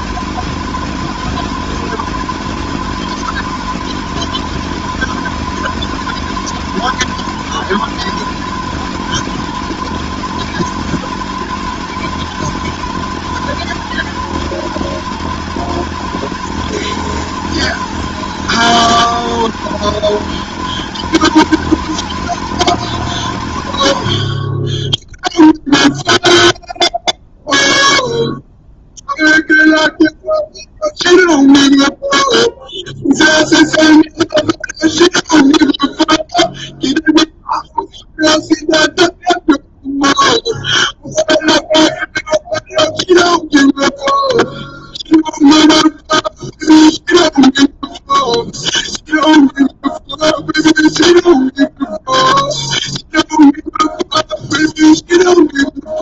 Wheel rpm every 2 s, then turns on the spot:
220, 220, 220, 220, 220, 220, 210, 220, 220, 210, 220, 200, 10, 0, 0, 0, 0, 0, 0, 0, 0, 0, 0, 0, 0, 0, 0, 0.
none